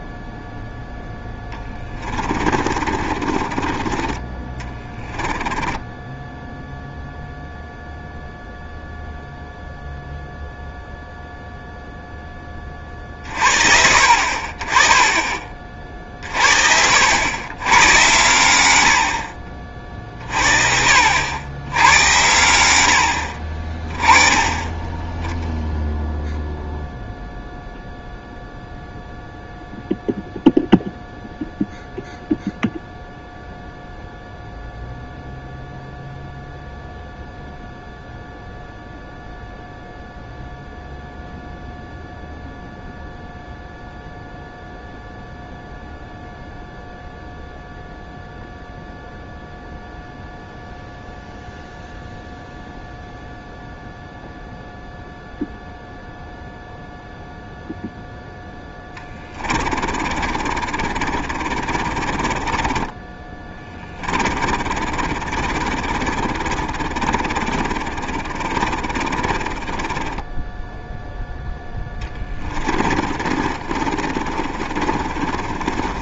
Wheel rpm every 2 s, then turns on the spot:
0, 30, 20, 0, 0, 0, 30, 20, 60, 80, 50, 80, 20, 0, 0, 0, 0, 0, 0, 0, 0, 0, 0, 0, 0, 0, 0, 0, 0, 10, 40, 20, 40, 50, 30, 10, 30, 40.
2-6 58-70 72-76